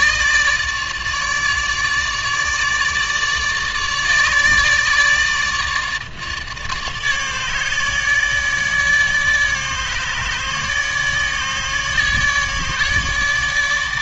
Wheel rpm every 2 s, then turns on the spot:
150, 150, 150, 150, 150, 150, 150.
none